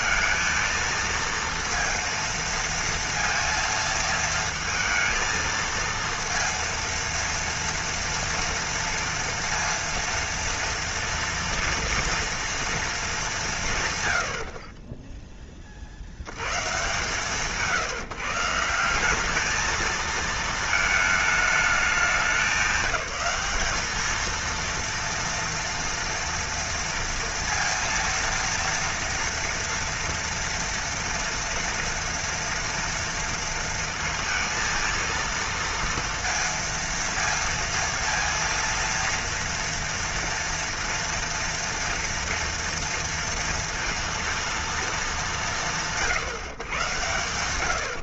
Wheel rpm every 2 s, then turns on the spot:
230, 230, 230, 230, 230, 230, 230, 40, 130, 180, 220, 190, 230, 230, 230, 240, 230, 230, 230, 230, 230, 230, 230, 140.
none